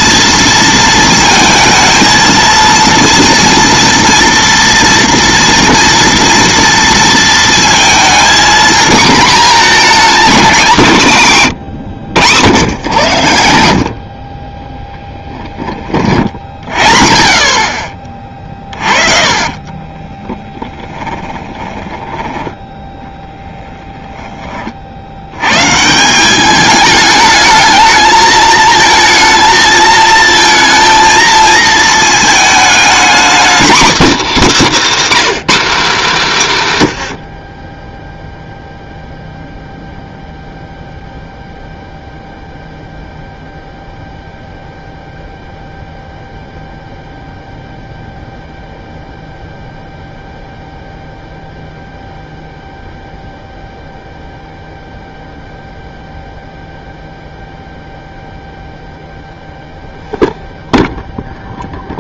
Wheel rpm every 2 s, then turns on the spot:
230, 230, 230, 230, 230, 230, 110, 20, 60, 30, 10, 10, 30, 200, 220, 220, 220, 280, 200, 0, 0, 0, 0, 0, 0, 0, 0, 0, 0, 0, 0.
18-22 36-38